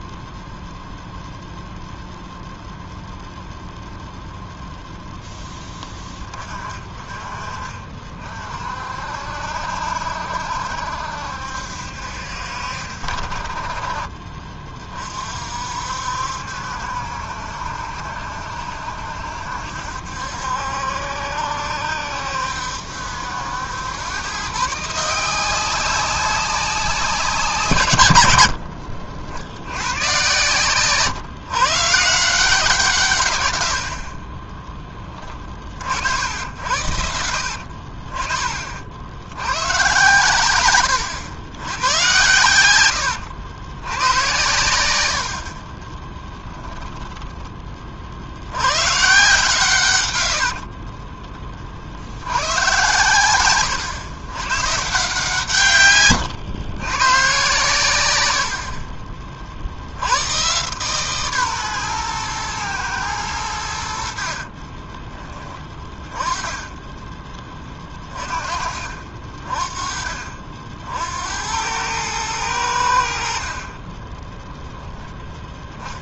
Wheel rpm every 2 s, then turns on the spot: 0, 0, 0, 30, 50, 60, 60, 30, 70, 70, 70, 70, 150, 190, 70, 130, 160, 20, 70, 50, 110, 100, 100, 10, 110, 50, 110, 140, 110, 60, 130, 120, 30, 20, 40, 60, 90, 0.
28-32 40-42 50-52 58-60 64-68